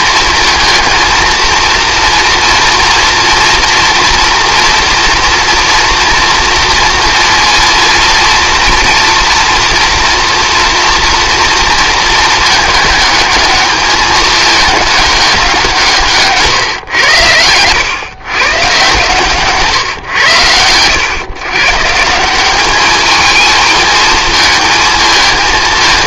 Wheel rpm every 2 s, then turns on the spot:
230, 230, 240, 230, 230, 230, 220, 210, 120, 130, 110, 210, 220.
none